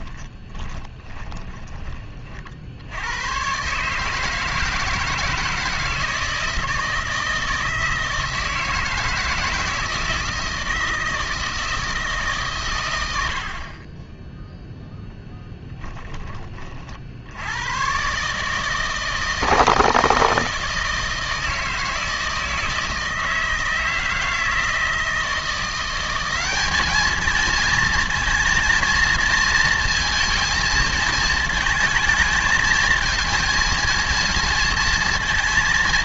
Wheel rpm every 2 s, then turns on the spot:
20, 50, 160, 160, 160, 160, 140, 10, 30, 150, 160, 160, 160, 200, 230, 230, 220, 230.
0-2